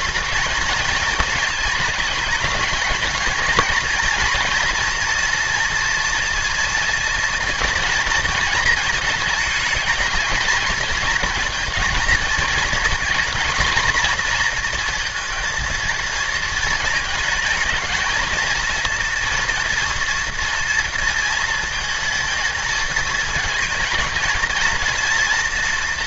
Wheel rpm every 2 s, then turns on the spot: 220, 210, 230, 230, 230, 220, 230, 230, 220, 230, 230, 220, 230.
none